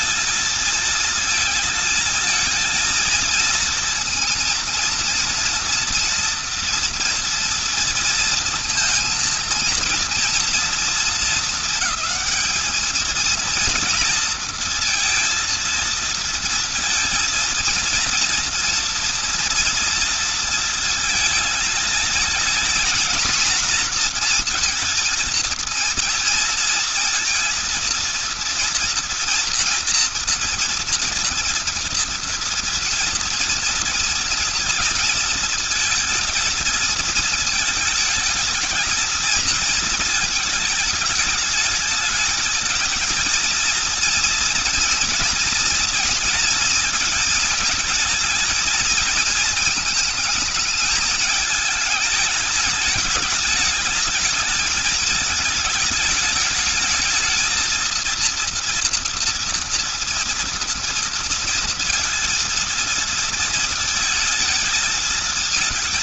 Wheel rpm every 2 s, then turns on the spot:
220, 220, 230, 230, 230, 230, 220, 230, 230, 230, 230, 220, 230, 230, 230, 230, 230, 230, 230, 220, 220, 220, 230, 220, 220, 220, 220, 220, 210, 230, 230, 230, 220.
none